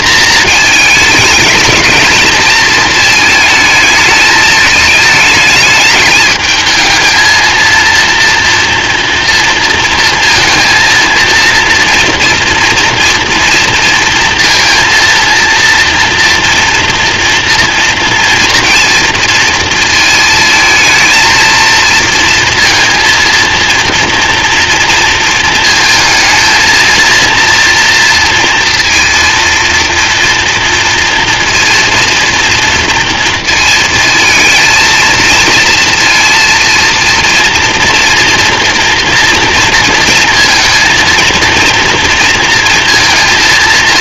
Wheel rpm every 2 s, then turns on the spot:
210, 220, 210, 220, 230, 230, 240, 230, 230, 230, 230, 230, 230, 230, 230, 230, 230, 230, 230, 240, 230, 230.
none